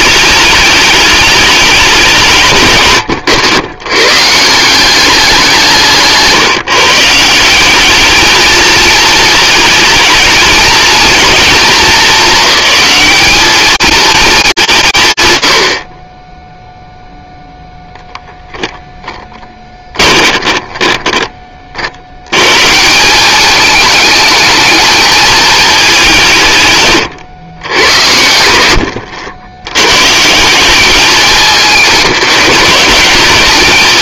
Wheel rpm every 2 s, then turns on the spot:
210, 130, 170, 150, 220, 220, 210, 180, 0, 0, 20, 150, 220, 140, 90, 190, 190.
20-22